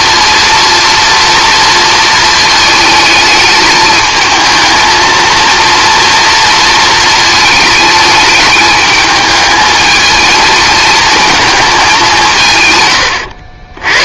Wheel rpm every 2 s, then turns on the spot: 230, 220, 220, 220, 210, 220, 100.
12-14